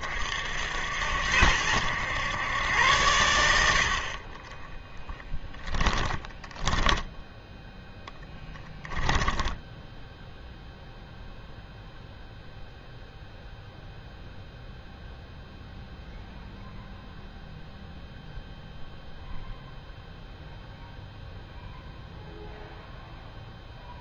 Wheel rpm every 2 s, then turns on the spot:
70, 110, 10, 10, 10, 0, 0, 0, 0, 0, 0, 0.
4-10